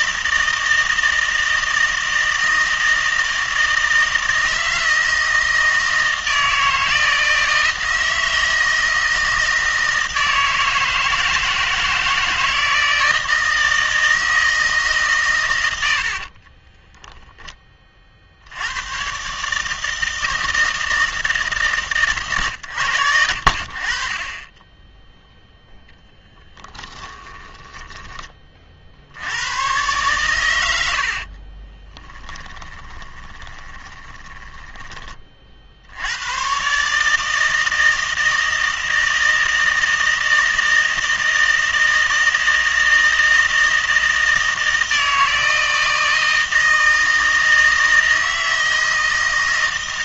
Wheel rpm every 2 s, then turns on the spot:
160, 160, 160, 160, 160, 160, 160, 160, 20, 100, 160, 110, 20, 20, 50, 80, 20, 10, 140, 160, 160, 160, 160, 160, 160.
16-18 26-28 30-34